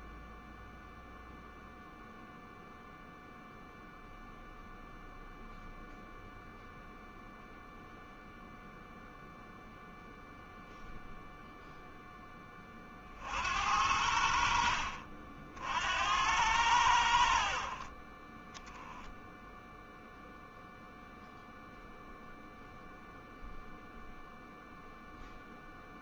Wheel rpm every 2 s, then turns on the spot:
0, 0, 0, 0, 0, 0, 40, 60, 80, 10, 0, 0, 0.
none